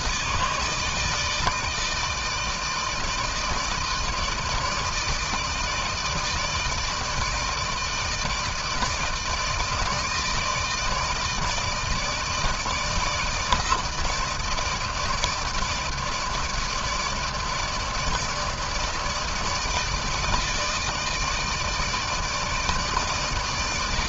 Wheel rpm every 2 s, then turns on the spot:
160, 160, 160, 160, 160, 160, 160, 160, 160, 150, 160, 160.
none